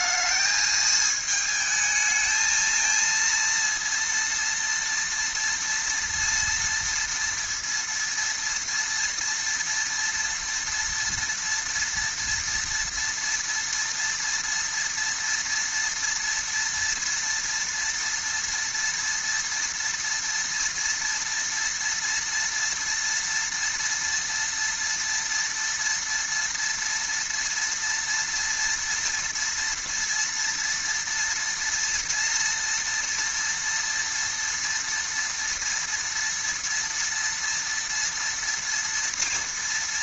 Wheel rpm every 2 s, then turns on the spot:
220, 220, 230, 230, 230, 230, 230, 230, 230, 230, 230, 230, 230, 230, 240, 230, 230, 230, 230, 230.
none